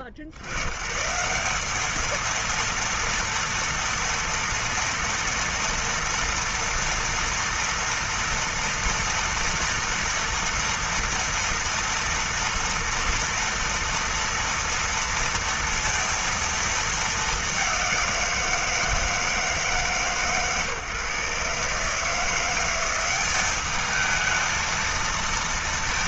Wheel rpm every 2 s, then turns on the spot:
40, 230, 230, 230, 240, 230, 230, 230, 230, 170, 130, 170, 220.
none